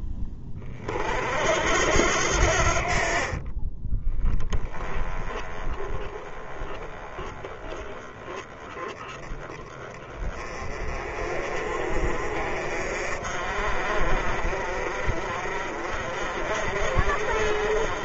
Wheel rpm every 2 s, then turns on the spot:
50, 50, 10, 10, 20, 30, 50, 40, 50.
none